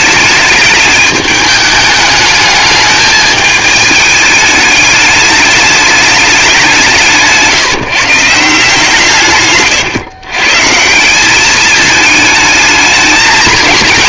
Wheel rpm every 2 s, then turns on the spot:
210, 210, 210, 180, 160, 140, 220.
none